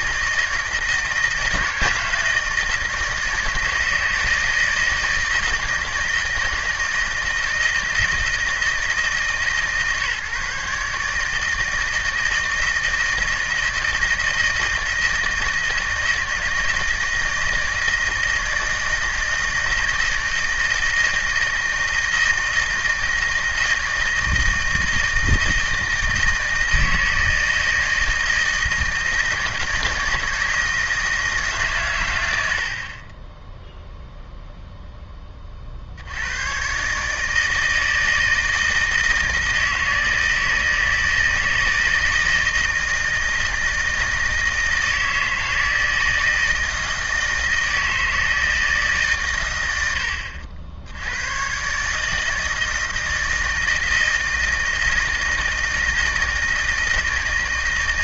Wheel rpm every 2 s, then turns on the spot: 160, 160, 160, 160, 160, 150, 160, 160, 160, 160, 160, 160, 160, 160, 160, 160, 70, 0, 130, 160, 160, 160, 160, 160, 160, 70, 160, 160, 160.
none